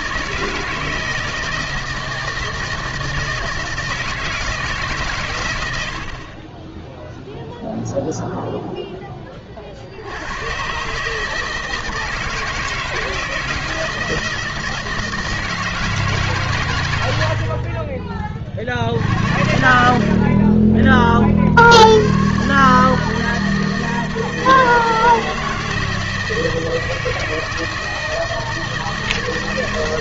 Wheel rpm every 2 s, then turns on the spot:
160, 160, 160, 10, 0, 130, 160, 160, 120, 50, 20, 150, 160, 160, 160.
6-8